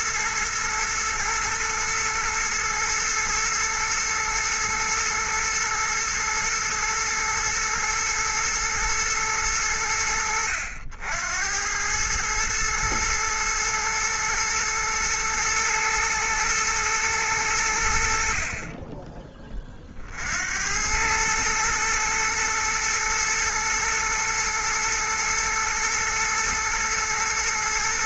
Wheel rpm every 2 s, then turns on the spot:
120, 120, 110, 110, 120, 70, 110, 110, 110, 30, 80, 110, 120, 110.
none